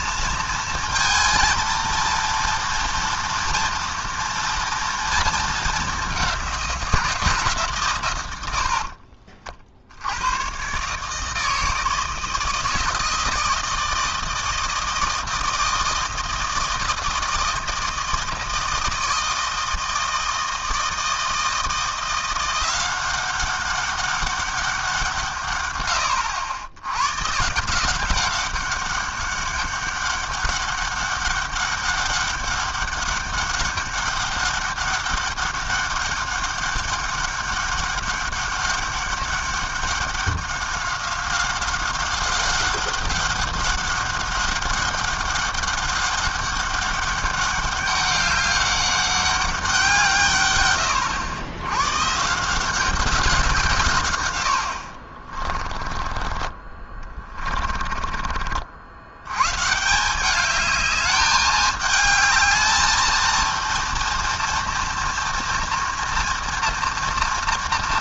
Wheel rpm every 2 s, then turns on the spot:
230, 240, 230, 180, 70, 120, 160, 160, 160, 160, 160, 180, 190, 90, 200, 200, 200, 200, 200, 200, 190, 190, 200, 200, 200, 120, 180, 80, 20, 50, 210, 220, 230, 230.
8-10